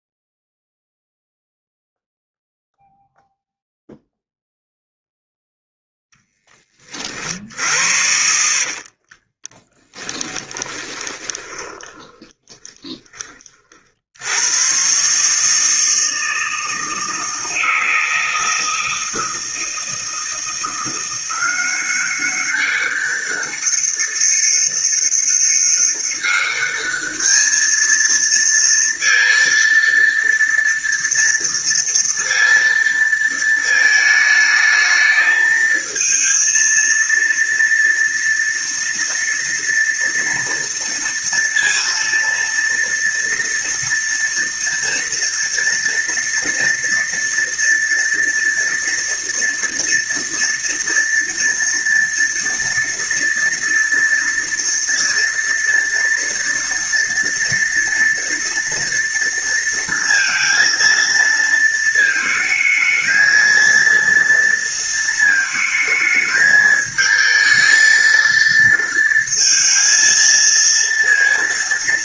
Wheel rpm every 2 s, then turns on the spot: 0, 0, 0, 10, 60, 10, 20, 90, 160, 160, 160, 190, 200, 200, 230, 230, 230, 220, 230, 230, 230, 230, 230, 230, 230, 230, 230, 230, 230, 230, 230, 220, 230, 220, 230, 230.
8-14